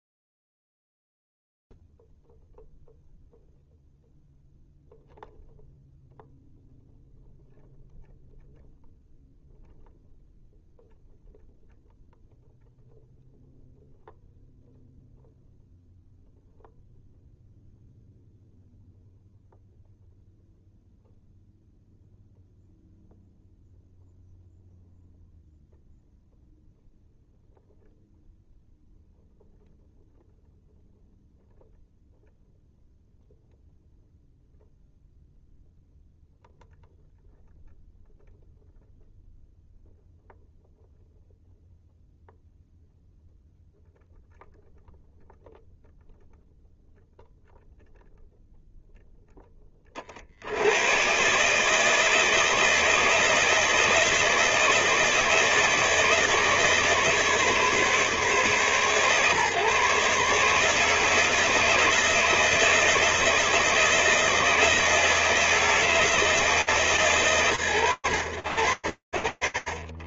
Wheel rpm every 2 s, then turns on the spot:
0, 0, 0, 0, 0, 0, 0, 0, 0, 0, 0, 0, 0, 0, 0, 0, 0, 0, 0, 0, 0, 0, 0, 0, 0, 140, 160, 160, 150, 140, 160, 160, 160, 150, 80.
none